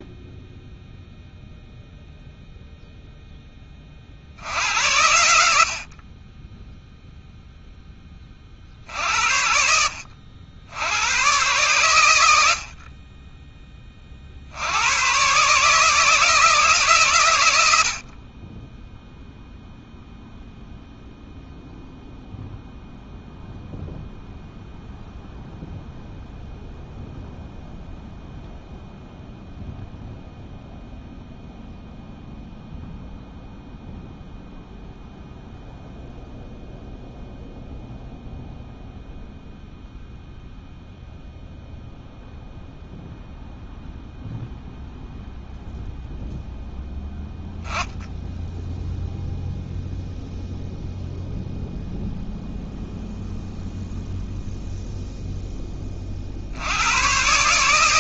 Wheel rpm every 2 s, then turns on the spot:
0, 0, 60, 20, 40, 70, 70, 50, 160, 40, 0, 0, 0, 0, 0, 0, 0, 0, 0, 0, 0, 0, 0, 0, 0, 0, 0, 0, 50.
none